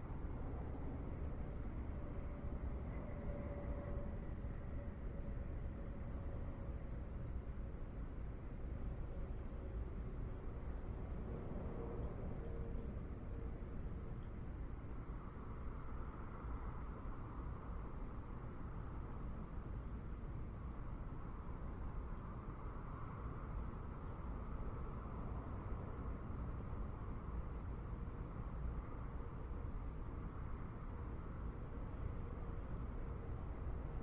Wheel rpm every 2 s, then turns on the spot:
0, 0, 0, 0, 0, 0, 0, 0, 0, 0, 0, 0, 0, 0, 0, 0, 0.
none